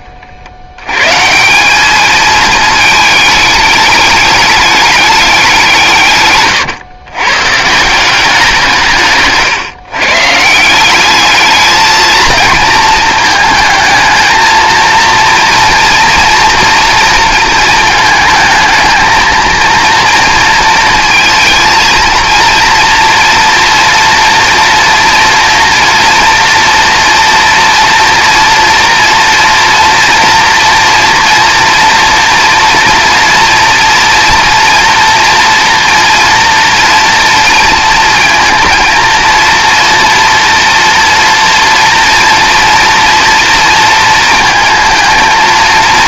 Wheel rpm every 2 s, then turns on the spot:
90, 220, 210, 120, 170, 170, 230, 230, 230, 220, 230, 240, 230, 230, 230, 230, 230, 230, 230, 230, 230, 230, 230.
none